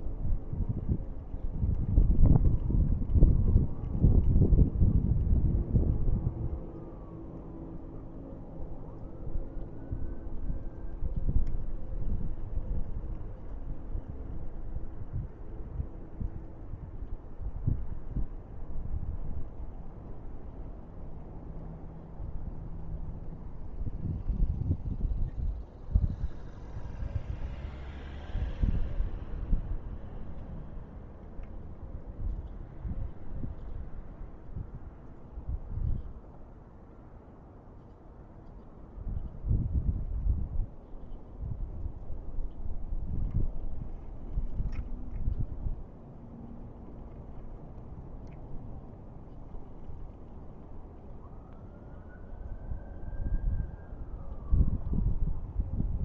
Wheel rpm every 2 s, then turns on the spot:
0, 0, 0, 0, 0, 0, 0, 0, 0, 0, 0, 0, 0, 0, 0, 0, 0, 0, 0, 0, 0, 0, 0, 0, 0, 0, 0, 0.
none